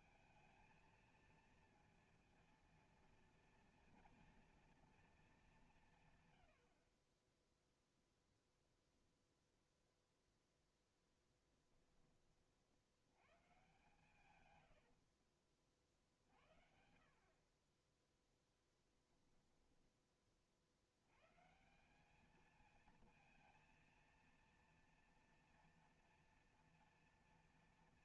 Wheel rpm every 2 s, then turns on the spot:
220, 230, 230, 60, 0, 0, 70, 90, 60, 10, 70, 220, 230, 230.
14-16 18-20